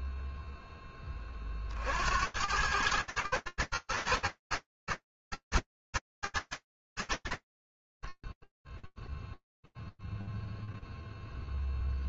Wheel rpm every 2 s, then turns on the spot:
40, 110, 110, 100, 10, 0.
none